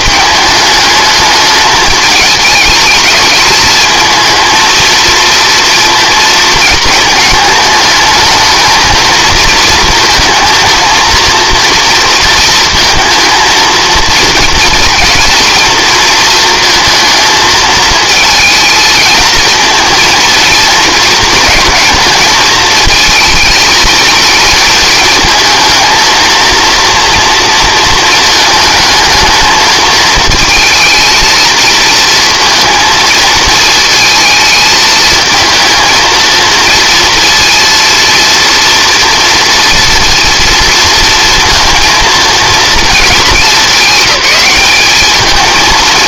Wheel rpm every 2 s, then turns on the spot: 210, 220, 230, 220, 220, 220, 230, 230, 230, 220, 230, 220, 230, 230, 220, 220, 230, 220, 230, 230, 230, 220, 210.
none